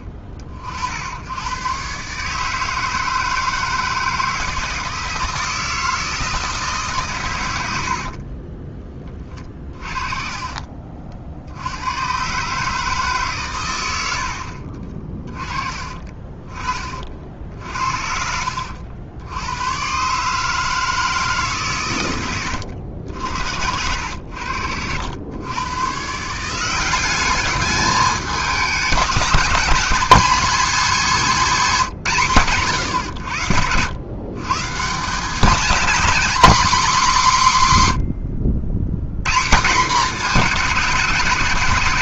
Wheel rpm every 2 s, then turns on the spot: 40, 160, 160, 160, 30, 40, 150, 60, 20, 70, 150, 100, 80, 170, 200, 240, 140, 140, 240, 90, 210.
14-16 24-26